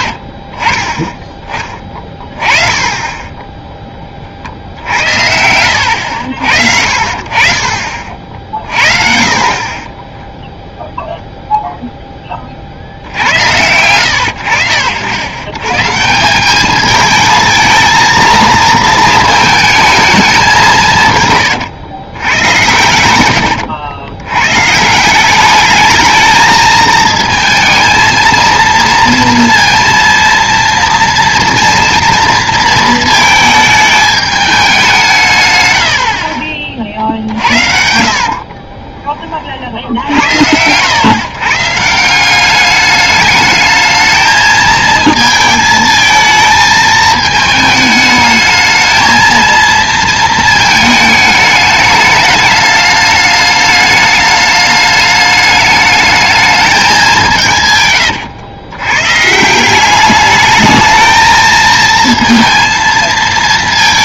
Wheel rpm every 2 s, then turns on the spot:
30, 20, 70, 60, 40, 0, 40, 80, 210, 230, 180, 90, 130, 220, 230, 230, 230, 200, 40, 30, 90, 200, 220, 220, 220, 220, 210, 210, 210, 110, 220, 230.
36-40